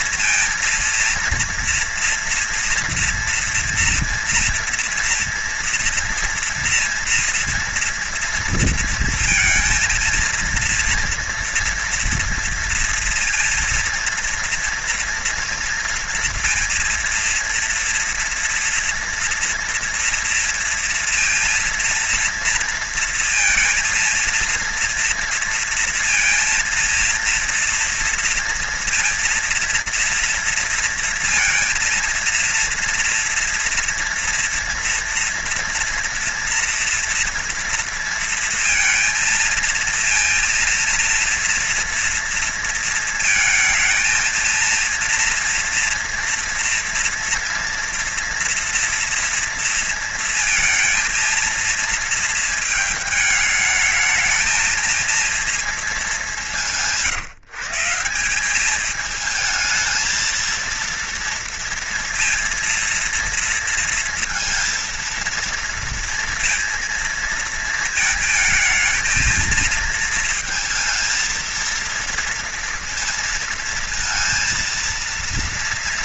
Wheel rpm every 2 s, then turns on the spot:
230, 230, 240, 230, 230, 230, 230, 240, 230, 230, 230, 230, 230, 230, 230, 230, 230, 230, 230, 230, 230, 230, 230, 230, 230, 220, 220, 220, 170, 200, 230, 230, 230, 230, 220, 230, 230, 230.
none